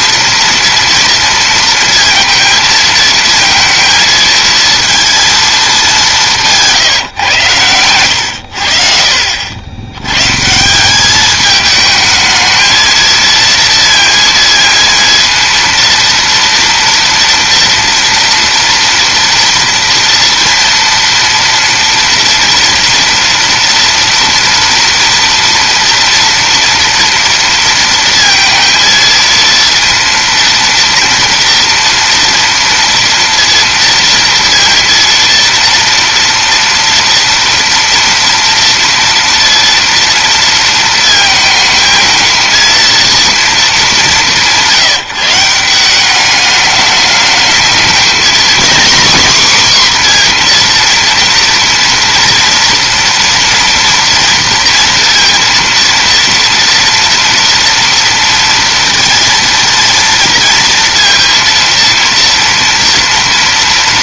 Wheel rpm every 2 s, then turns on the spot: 230, 230, 230, 160, 60, 180, 220, 230, 230, 230, 230, 230, 230, 230, 230, 230, 230, 230, 230, 230, 230, 230, 170, 210, 260, 240, 230, 230, 230, 230, 230, 230.
none